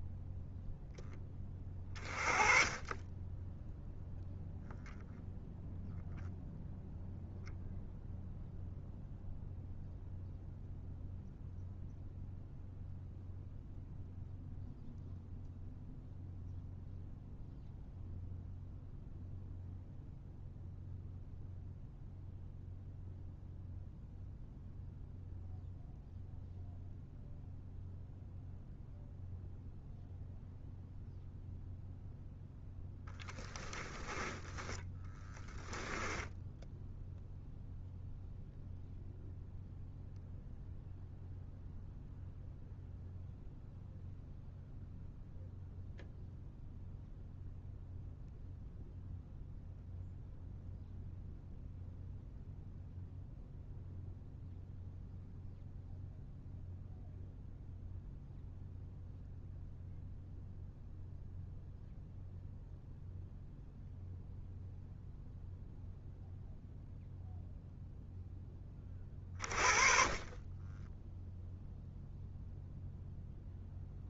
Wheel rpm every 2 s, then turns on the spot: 0, 20, 0, 0, 0, 0, 0, 0, 0, 0, 0, 0, 0, 0, 0, 0, 0, 20, 0, 0, 0, 0, 0, 0, 0, 0, 0, 0, 0, 0, 0, 0, 0, 0, 20, 20, 0.
34-36